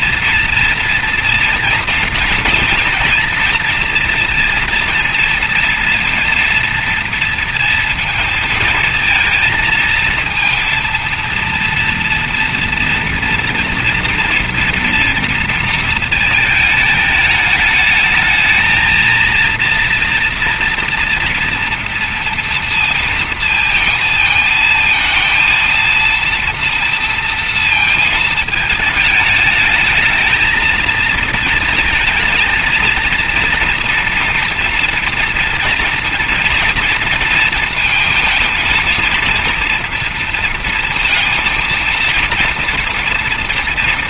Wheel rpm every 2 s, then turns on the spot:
230, 230, 230, 230, 220, 230, 230, 240, 220, 220, 230, 230, 220, 230, 220, 220, 230, 240, 230, 220, 230, 230.
none